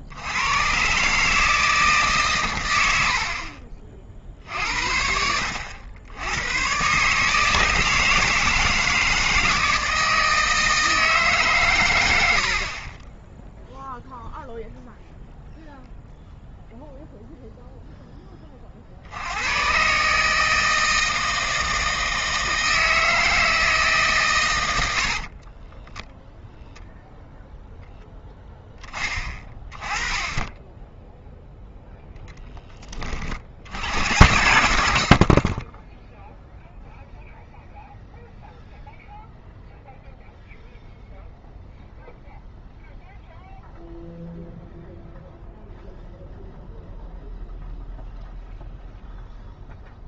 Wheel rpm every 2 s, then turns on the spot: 70, 110, 60, 90, 160, 160, 70, 0, 0, 30, 160, 160, 120, 0, 10, 10, 10, 100, 0, 0, 0, 0, 0, 0, 0.
12-14